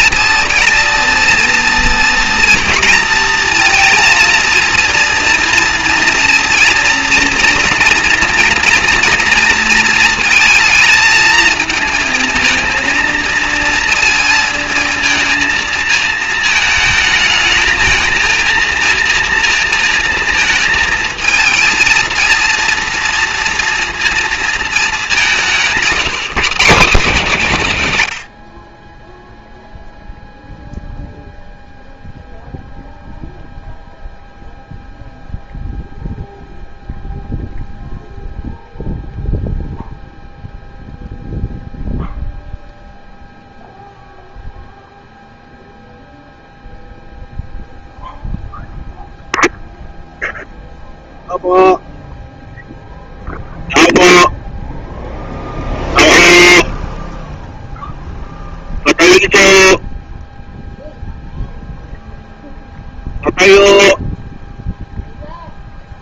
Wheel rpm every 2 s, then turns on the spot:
230, 230, 230, 230, 230, 220, 230, 230, 220, 230, 230, 230, 220, 210, 70, 0, 0, 0, 0, 0, 0, 0, 0, 0, 0, 0, 0, 0, 0, 0, 0, 0, 0.
none